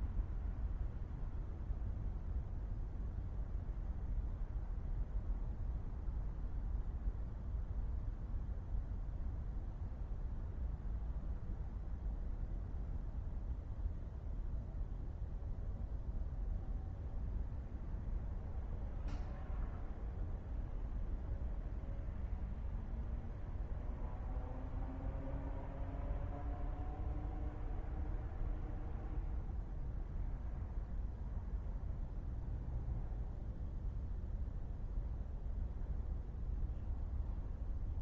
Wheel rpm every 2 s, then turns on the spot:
0, 0, 0, 0, 0, 0, 0, 0, 0, 0, 0, 0, 0, 0, 0, 0, 0, 0, 0.
none